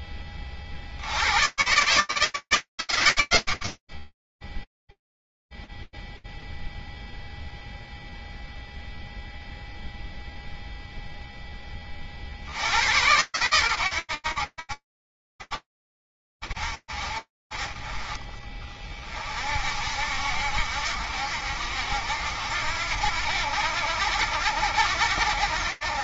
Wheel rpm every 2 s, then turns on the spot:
70, 100, 0, 0, 0, 20, 110, 50, 40, 40, 70, 70, 60.
none